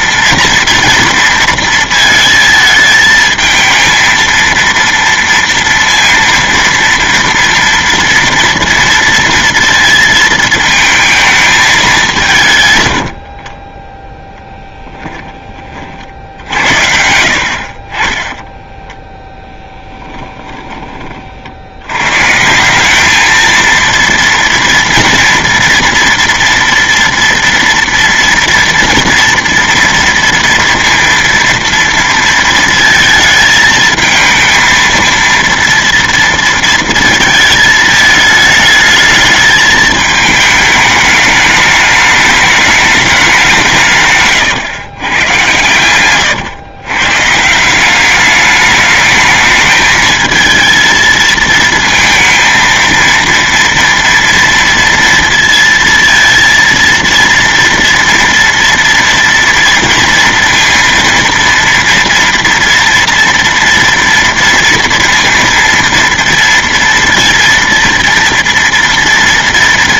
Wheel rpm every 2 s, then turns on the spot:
230, 220, 230, 230, 230, 220, 120, 10, 80, 10, 20, 170, 230, 230, 230, 230, 230, 230, 230, 220, 210, 210, 130, 120, 210, 230, 230, 230, 230, 230, 230, 230, 230, 230, 230.
14-16 18-22